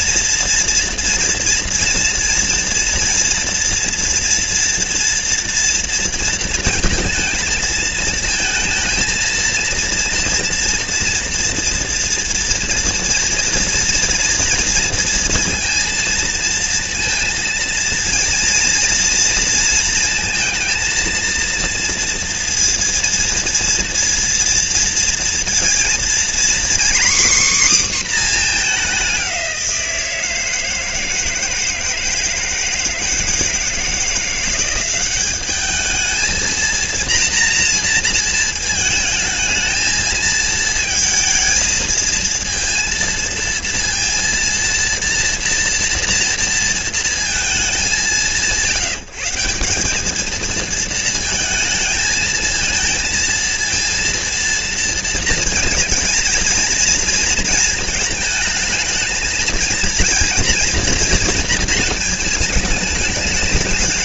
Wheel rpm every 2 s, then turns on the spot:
240, 230, 230, 230, 230, 230, 230, 230, 230, 230, 230, 230, 230, 260, 200, 160, 160, 190, 230, 220, 220, 230, 230, 230, 160, 220, 230, 230, 230, 220, 230, 220.
none